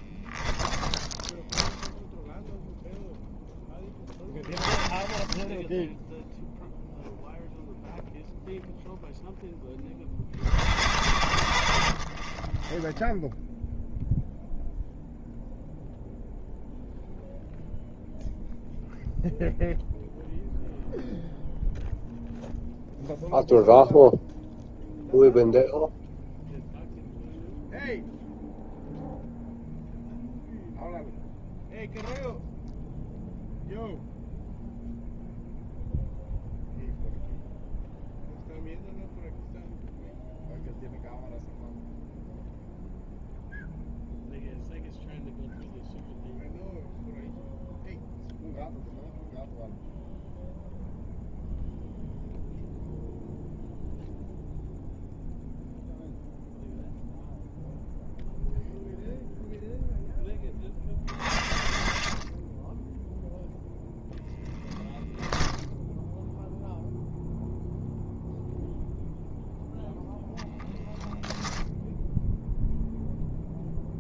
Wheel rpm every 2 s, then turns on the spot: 20, 0, 10, 0, 0, 70, 10, 0, 0, 0, 0, 0, 0, 0, 0, 0, 0, 0, 0, 0, 0, 0, 0, 0, 0, 0, 0, 0, 0, 0, 10, 0, 10, 0, 0, 10, 0.
0-2